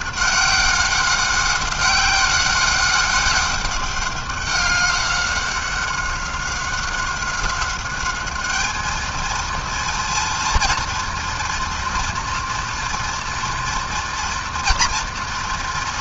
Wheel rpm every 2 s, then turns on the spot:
190, 190, 200, 190, 210, 230, 240, 230.
none